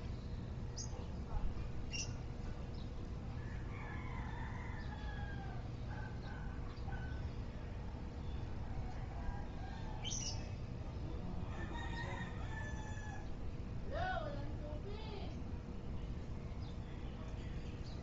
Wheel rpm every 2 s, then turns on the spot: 0, 0, 0, 0, 0, 0, 0, 0, 0.
none